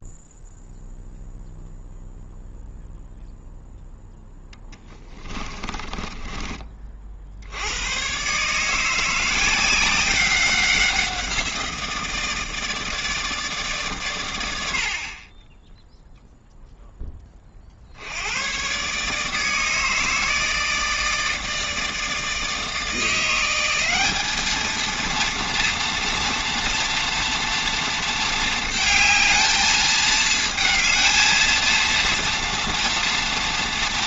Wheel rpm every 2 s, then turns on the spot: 0, 0, 10, 30, 150, 190, 160, 80, 0, 120, 160, 160, 220, 240, 220, 220, 230.
4-6